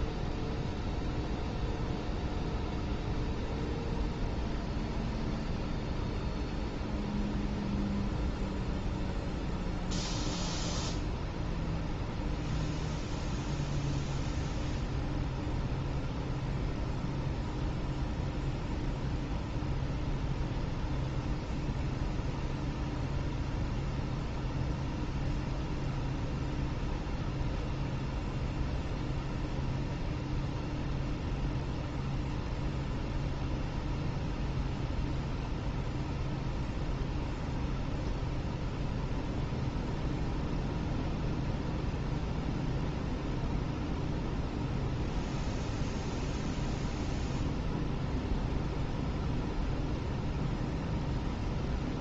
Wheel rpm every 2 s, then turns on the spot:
0, 0, 0, 0, 0, 0, 0, 0, 0, 0, 0, 0, 0, 0, 0, 0, 0, 0, 0, 0, 0, 0, 0, 0, 0, 0.
none